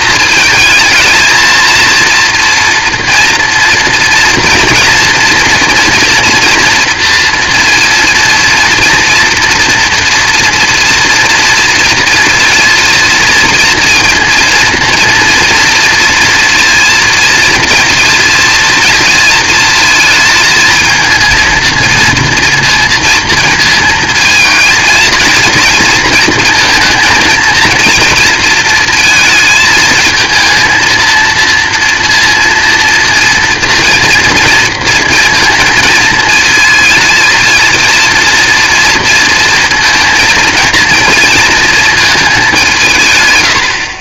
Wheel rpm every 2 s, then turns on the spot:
220, 230, 230, 230, 230, 230, 230, 230, 230, 230, 220, 230, 230, 230, 230, 230, 230, 230, 230, 230, 230, 180.
none